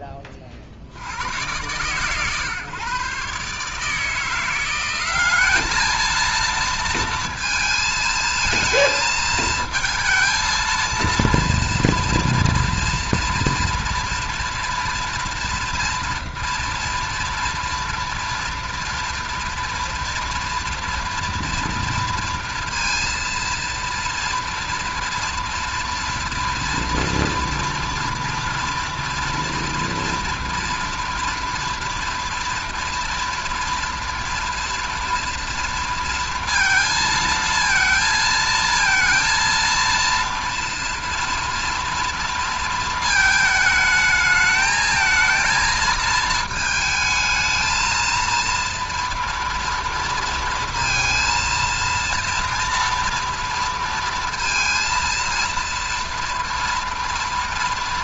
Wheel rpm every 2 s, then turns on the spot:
50, 130, 180, 230, 220, 230, 230, 230, 230, 230, 230, 230, 230, 230, 230, 230, 230, 240, 230, 220, 230, 230, 220, 220, 230, 230, 230, 230, 230.
none